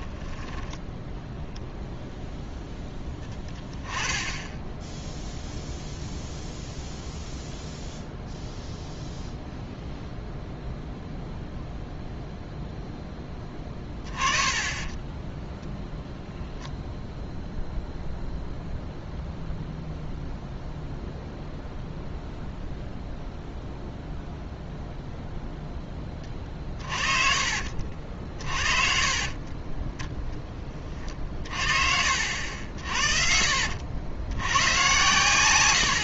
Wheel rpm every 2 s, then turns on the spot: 10, 0, 10, 0, 0, 0, 0, 20, 0, 0, 0, 0, 0, 40, 50, 20, 60, 100.
0-2